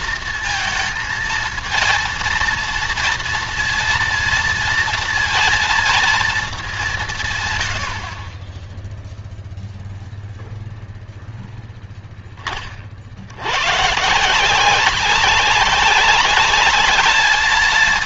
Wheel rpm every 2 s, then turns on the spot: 230, 230, 230, 180, 10, 0, 50, 180, 210.
none